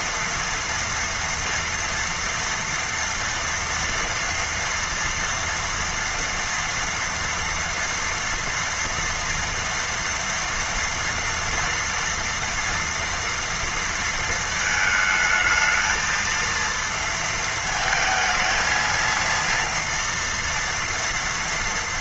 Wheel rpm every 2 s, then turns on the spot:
230, 230, 230, 240, 230, 230, 230, 220, 230, 220, 230.
none